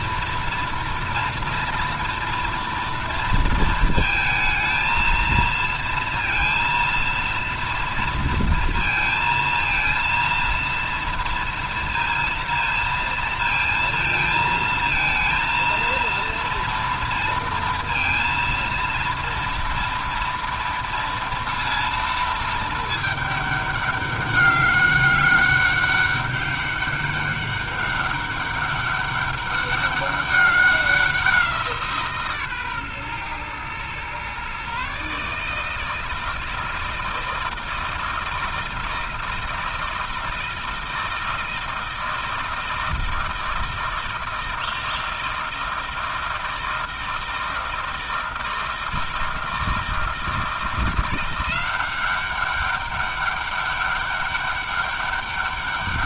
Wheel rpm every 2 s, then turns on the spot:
230, 230, 220, 230, 230, 230, 230, 230, 230, 230, 240, 220, 200, 200, 200, 190, 140, 130, 160, 160, 160, 160, 160, 160, 160, 170, 190, 200.
none